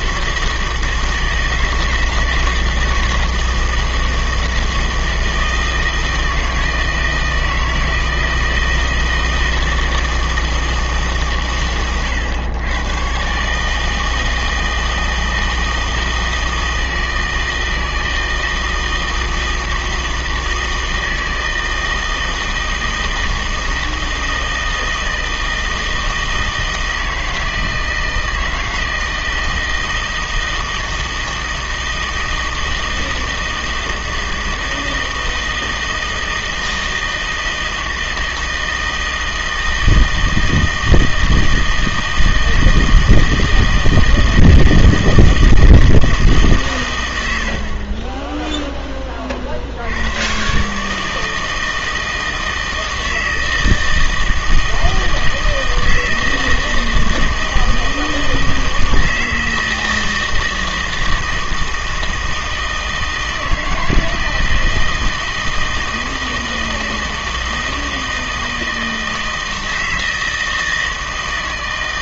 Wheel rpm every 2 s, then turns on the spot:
160, 160, 160, 160, 160, 160, 110, 160, 160, 160, 160, 160, 160, 160, 160, 160, 160, 160, 160, 160, 160, 160, 160, 140, 10, 140, 160, 160, 160, 160, 160, 160, 160, 160, 160, 160.
none